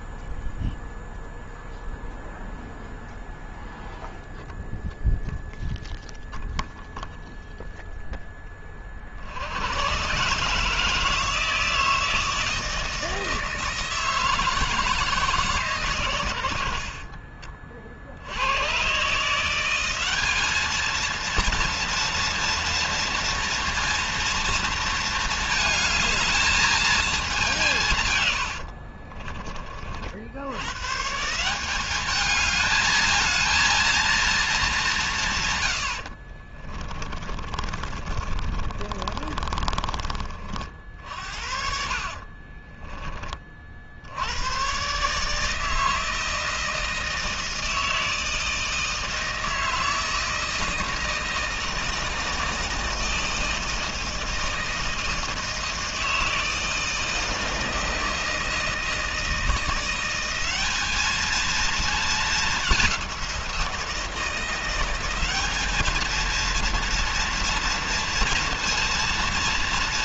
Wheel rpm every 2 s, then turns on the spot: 0, 0, 0, 0, 20, 130, 160, 160, 80, 100, 210, 240, 230, 220, 90, 80, 210, 220, 60, 30, 40, 30, 90, 160, 160, 160, 160, 160, 160, 160, 190, 200, 170, 230, 230.
28-30 36-40 42-44